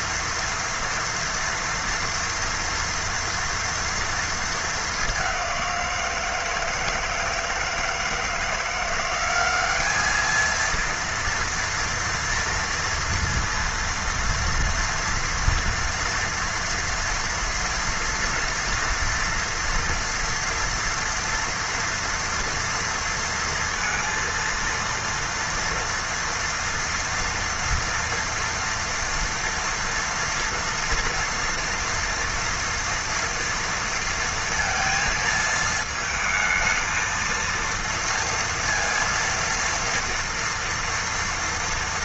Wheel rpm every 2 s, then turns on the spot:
230, 230, 210, 160, 170, 230, 230, 230, 240, 230, 230, 230, 230, 230, 230, 230, 230, 230, 220, 230, 230.
none